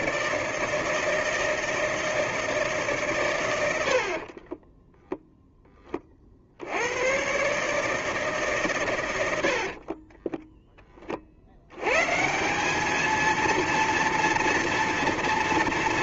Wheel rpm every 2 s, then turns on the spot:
160, 160, 30, 60, 140, 10, 190, 230.
4-6